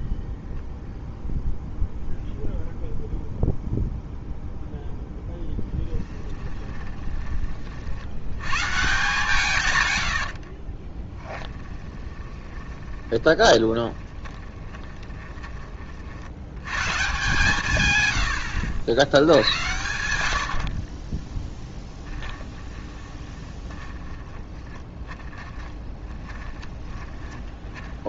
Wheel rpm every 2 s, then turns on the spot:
0, 0, 0, 20, 130, 30, 20, 20, 120, 80, 50, 20, 20, 20.
6-8 10-16 20-28